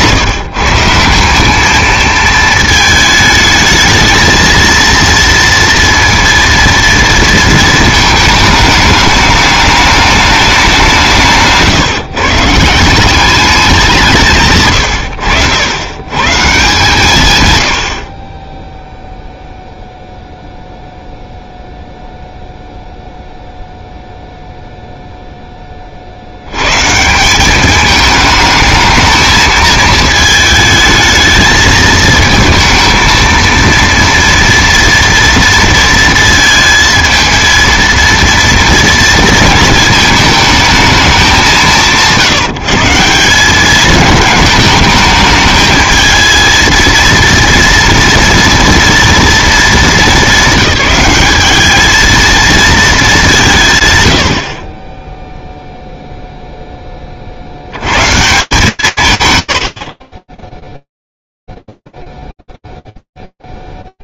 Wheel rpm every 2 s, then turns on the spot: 180, 220, 230, 230, 210, 180, 190, 110, 140, 0, 0, 0, 0, 150, 220, 220, 230, 230, 220, 230, 210, 170, 220, 230, 240, 200, 200, 30, 10, 160, 0, 0.
none